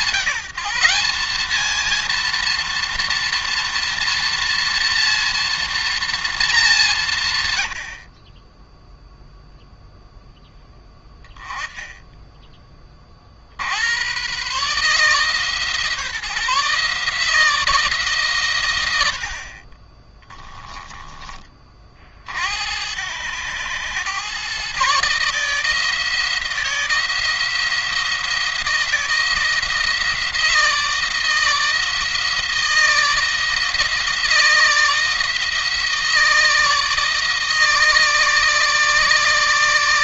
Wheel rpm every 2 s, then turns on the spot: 190, 240, 230, 200, 20, 10, 20, 140, 160, 100, 10, 80, 130, 160, 170, 160, 160, 160, 160, 150.
20-22